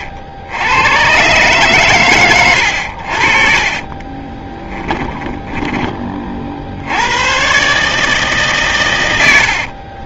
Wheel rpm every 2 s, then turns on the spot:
80, 60, 20, 60, 140.
4-6